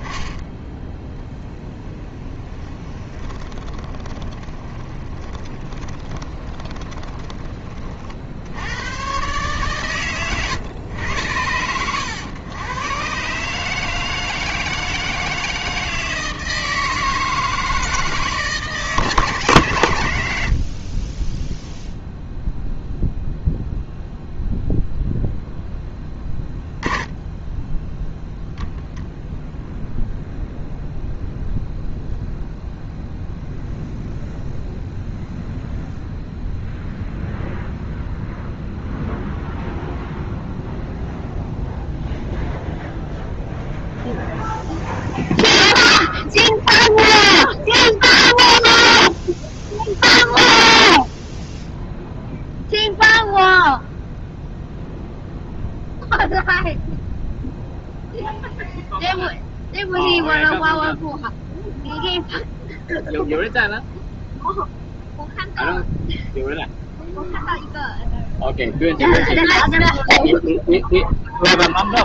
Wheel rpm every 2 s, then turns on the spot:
0, 20, 20, 10, 110, 100, 120, 160, 160, 150, 40, 0, 0, 10, 0, 0, 0, 0, 0, 0, 0, 0, 0, 0, 0, 0, 0, 0, 0, 0, 0, 0, 0, 0, 0, 0.
2-8 20-22